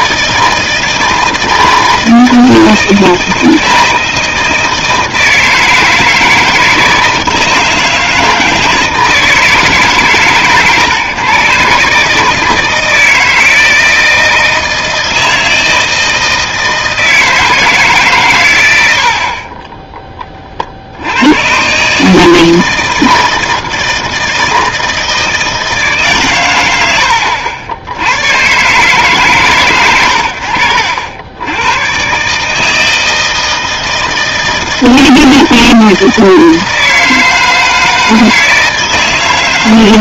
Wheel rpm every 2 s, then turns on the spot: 160, 160, 160, 160, 160, 120, 160, 160, 160, 100, 50, 160, 160, 110, 120, 50, 150, 160, 160, 160.
none